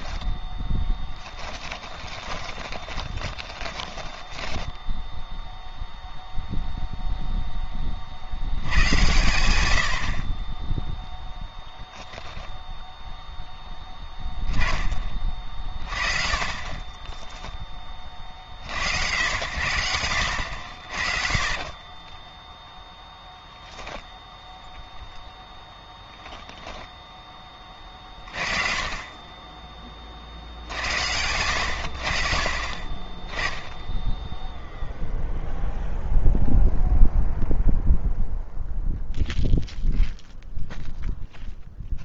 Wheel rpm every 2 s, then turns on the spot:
10, 10, 0, 0, 100, 0, 0, 20, 20, 70, 70, 0, 0, 0, 30, 80, 40, 0, 0, 0, 0.
0-4